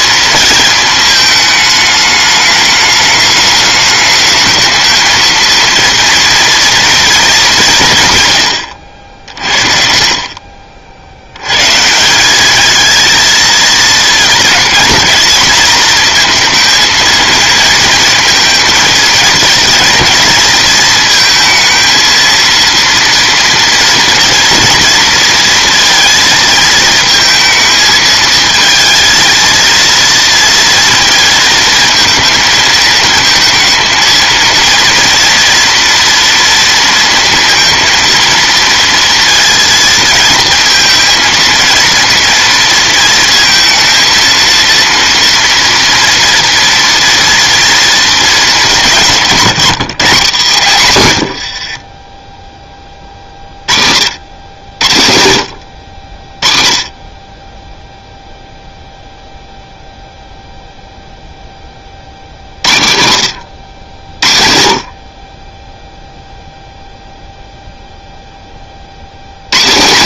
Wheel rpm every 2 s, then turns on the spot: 220, 210, 220, 230, 90, 50, 220, 230, 230, 220, 220, 230, 230, 220, 220, 230, 220, 230, 230, 230, 220, 230, 230, 230, 190, 130, 20, 90, 30, 0, 0, 70, 50, 0, 30.
none